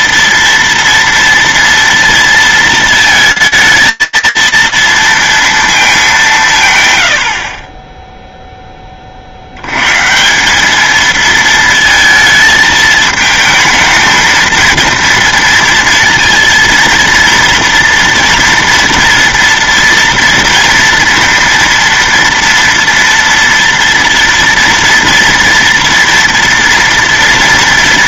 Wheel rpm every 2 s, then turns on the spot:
240, 230, 230, 120, 10, 200, 220, 230, 230, 240, 230, 230, 230, 230.
none